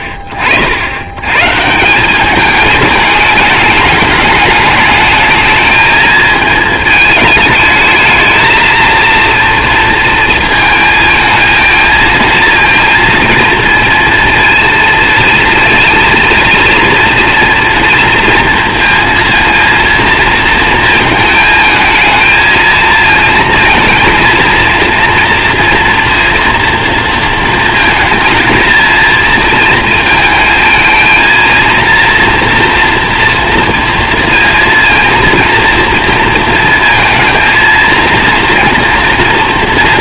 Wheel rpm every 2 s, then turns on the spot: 70, 210, 210, 220, 220, 220, 230, 230, 230, 230, 220, 220, 230, 230, 230, 220, 230, 230, 230, 230.
none